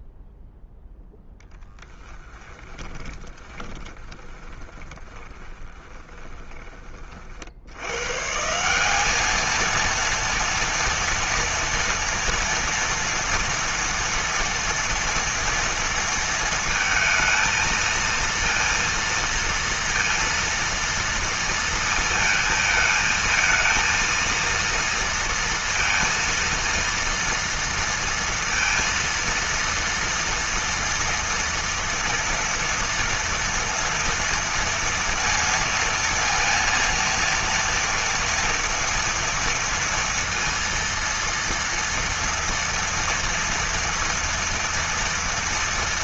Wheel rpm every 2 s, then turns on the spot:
0, 20, 20, 20, 180, 240, 230, 230, 230, 230, 230, 220, 230, 230, 230, 230, 230, 230, 230, 230, 230, 230, 230.
2-6